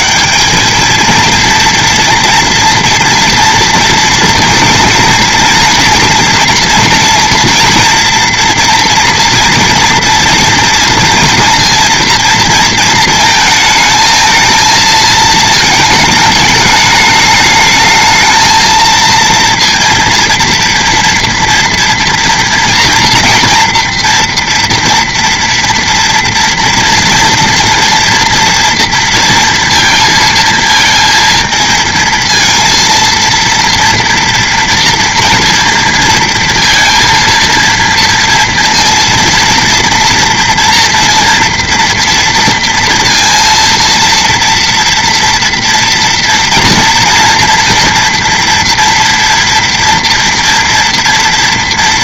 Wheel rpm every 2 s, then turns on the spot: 200, 230, 240, 230, 230, 230, 230, 220, 220, 220, 230, 230, 240, 230, 230, 230, 230, 230, 230, 230, 230, 230, 230, 230, 230, 240.
none